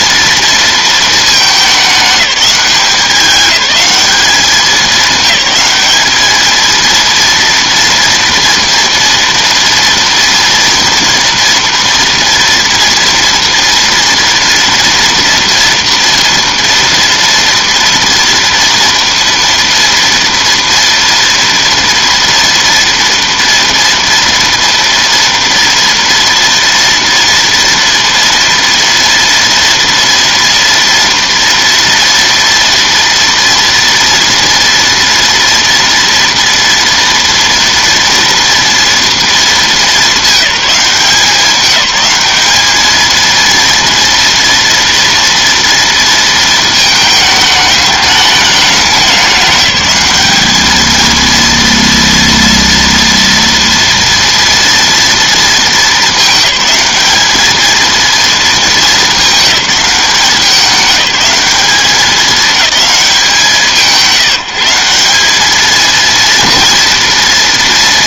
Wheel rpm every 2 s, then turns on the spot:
230, 200, 200, 230, 230, 240, 230, 230, 230, 230, 230, 230, 230, 230, 230, 230, 230, 230, 230, 230, 190, 220, 230, 230, 200, 220, 230, 230, 210, 220, 190, 210, 180, 230.
none